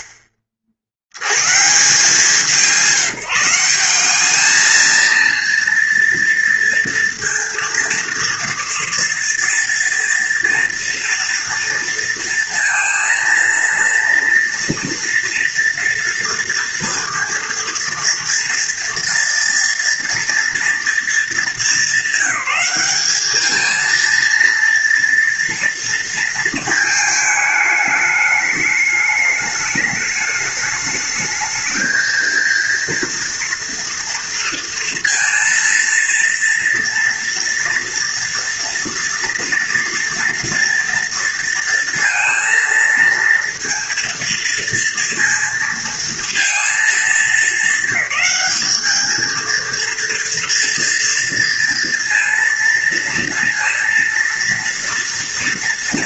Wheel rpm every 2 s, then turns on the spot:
70, 180, 220, 230, 230, 230, 230, 230, 230, 230, 220, 210, 230, 220, 210, 220, 230, 230, 230, 230, 230, 230, 230, 210, 220, 230, 230, 230.
none